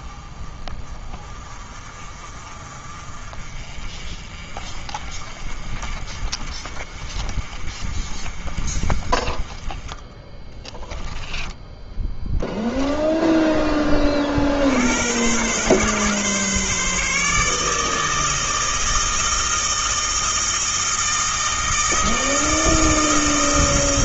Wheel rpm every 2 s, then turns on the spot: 30, 40, 40, 40, 30, 10, 10, 70, 140, 160, 160, 160.
10-12